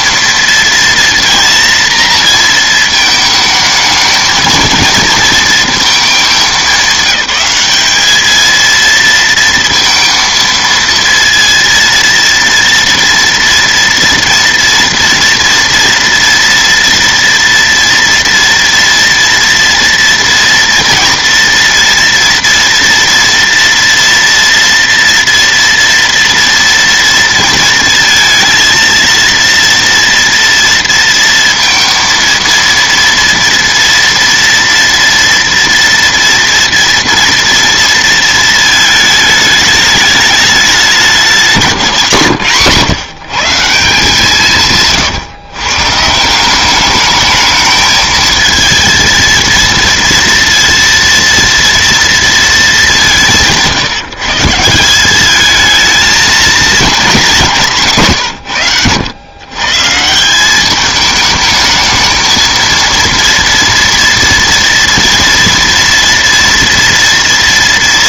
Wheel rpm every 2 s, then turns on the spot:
230, 230, 230, 210, 230, 230, 230, 230, 230, 230, 230, 230, 230, 230, 230, 230, 230, 230, 230, 220, 200, 150, 160, 200, 220, 230, 210, 180, 220, 110, 190, 230, 230, 230.
44-46